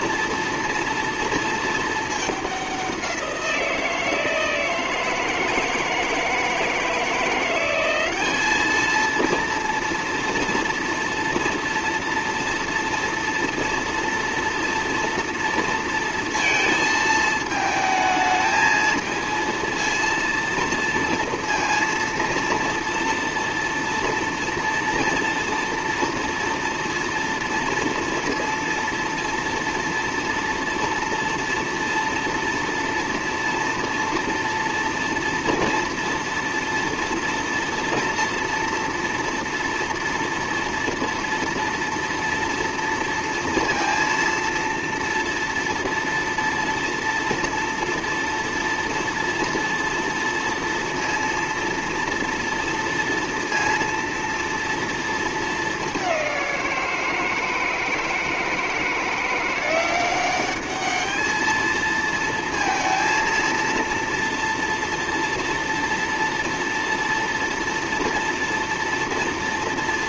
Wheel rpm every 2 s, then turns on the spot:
230, 190, 160, 160, 220, 230, 230, 230, 220, 220, 230, 230, 230, 230, 230, 230, 230, 230, 230, 230, 240, 230, 230, 230, 230, 230, 230, 230, 170, 170, 210, 230, 230, 230, 230.
none